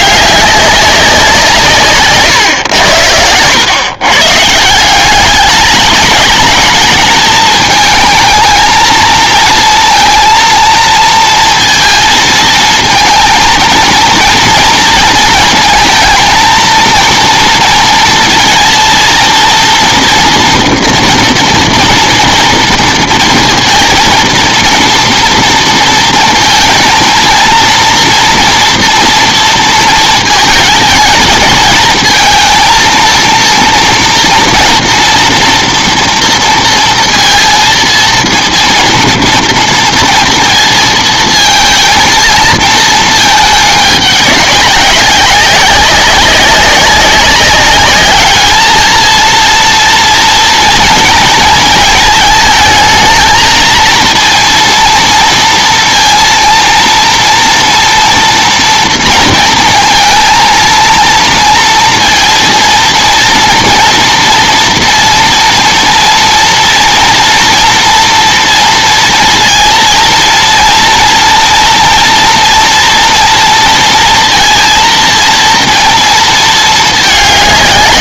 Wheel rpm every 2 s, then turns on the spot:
200, 90, 160, 220, 220, 230, 230, 230, 230, 230, 240, 230, 230, 230, 230, 220, 230, 230, 230, 230, 230, 230, 190, 190, 220, 230, 220, 230, 230, 230, 230, 230, 240, 230, 230, 230, 240, 230, 220.
none